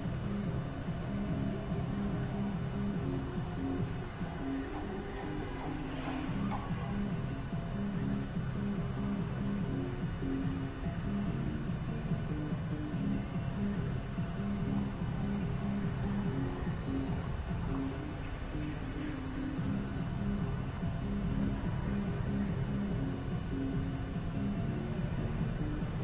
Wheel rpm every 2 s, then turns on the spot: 0, 0, 0, 0, 0, 0, 0, 0, 0, 0, 0, 0, 0.
none